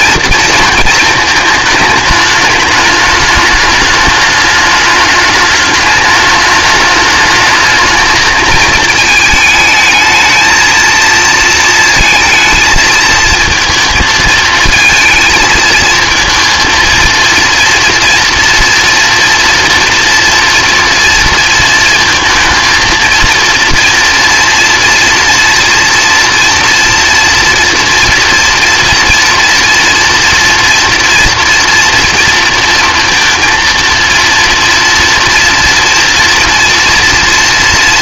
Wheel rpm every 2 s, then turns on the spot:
230, 210, 210, 210, 220, 230, 220, 220, 220, 230, 230, 230, 230, 230, 240, 230, 230, 230, 230.
none